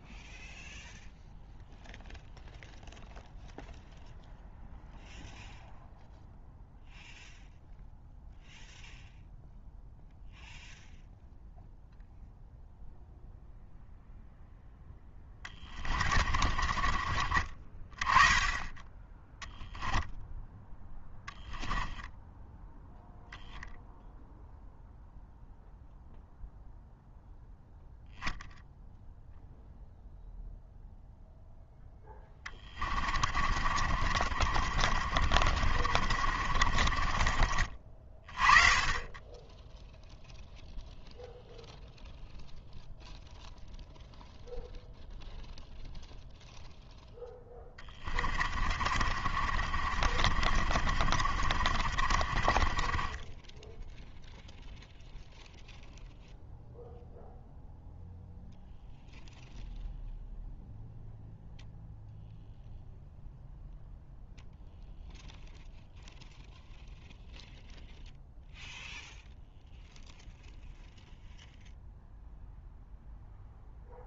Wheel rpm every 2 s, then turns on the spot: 0, 0, 0, 0, 0, 0, 0, 10, 30, 10, 10, 0, 0, 0, 0, 0, 30, 40, 40, 20, 0, 0, 0, 0, 40, 40, 20, 0, 0, 0, 0, 0, 0, 0, 0, 0, 0.
14-18 20-22 32-38 48-54